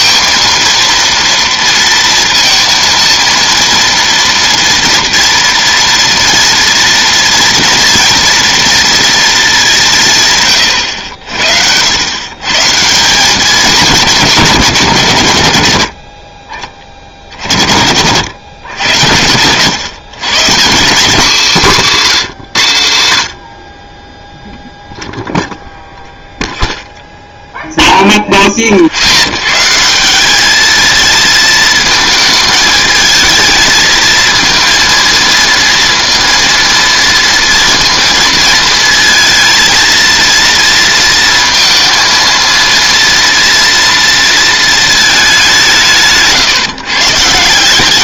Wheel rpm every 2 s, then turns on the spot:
230, 230, 230, 230, 230, 120, 150, 170, 30, 110, 180, 140, 0, 0, 30, 220, 220, 230, 230, 220, 230, 230, 220, 150.
none